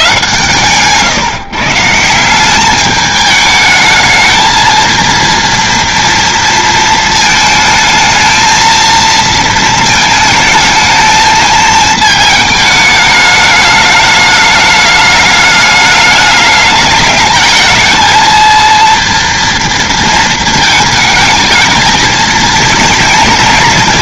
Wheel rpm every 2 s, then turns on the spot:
150, 150, 220, 230, 220, 220, 220, 210, 210, 230, 230, 220.
none